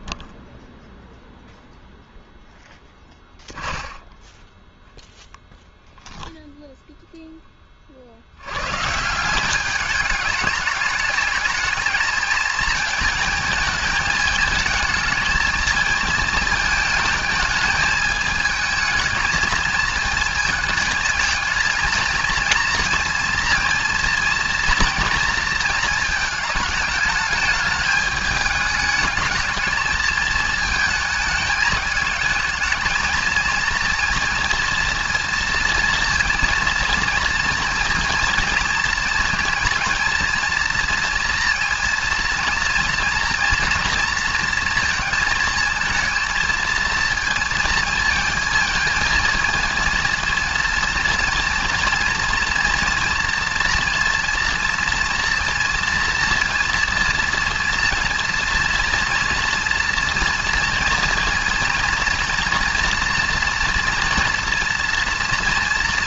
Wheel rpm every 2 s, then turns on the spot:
0, 0, 0, 10, 120, 210, 220, 220, 220, 220, 220, 230, 230, 220, 210, 220, 220, 230, 230, 230, 230, 230, 230, 230, 230, 230, 230, 230, 230, 230, 240, 240, 230.
none